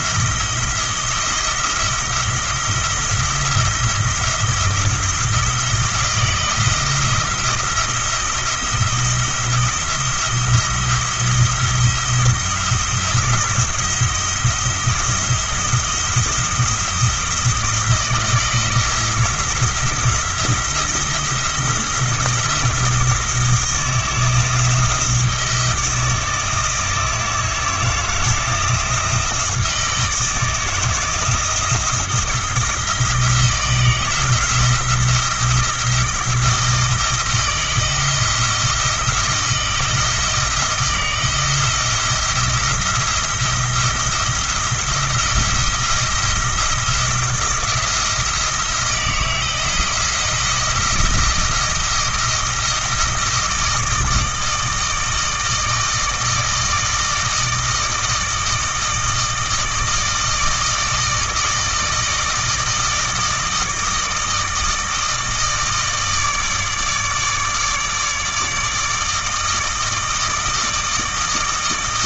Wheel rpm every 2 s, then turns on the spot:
170, 170, 170, 170, 170, 170, 170, 170, 170, 160, 170, 170, 170, 160, 170, 160, 170, 170, 160, 170, 160, 170, 170, 160, 170, 170, 160, 160, 160, 160, 160, 160, 160, 150, 160, 160.
none